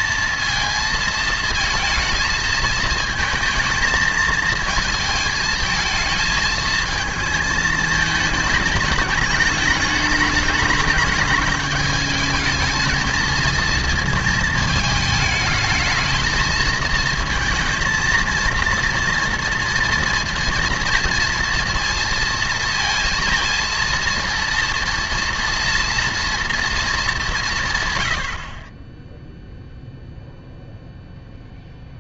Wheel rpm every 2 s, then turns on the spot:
220, 220, 220, 220, 220, 210, 220, 220, 220, 230, 230, 230, 230, 230, 40, 0.
none